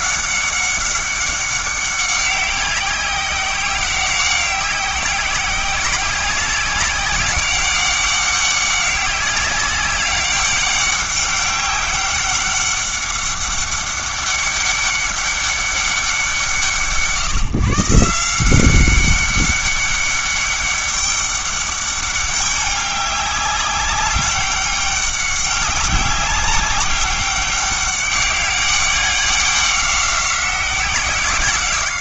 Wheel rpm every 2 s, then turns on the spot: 190, 190, 190, 190, 200, 200, 200, 200, 170, 190, 200, 200, 200, 200, 200, 190.
none